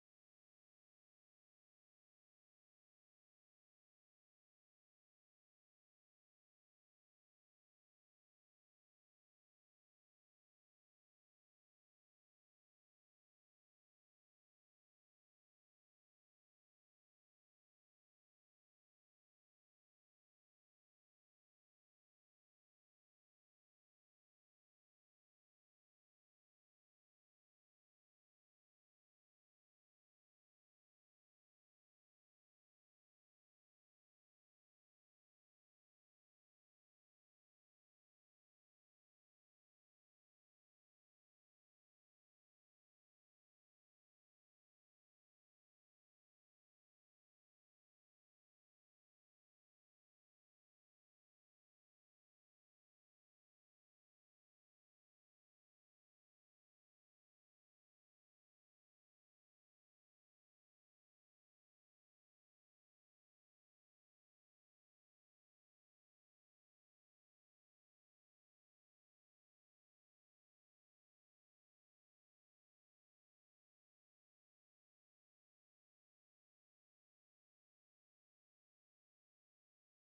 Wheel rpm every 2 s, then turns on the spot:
0, 0, 0, 0, 0, 0, 0, 0, 0, 0, 0, 0, 0, 0, 0, 0, 0, 0, 0, 0, 0, 0, 0, 0, 0, 0, 0, 0, 0, 0, 0, 0, 0, 0, 0, 0, 0, 0, 0, 0.
none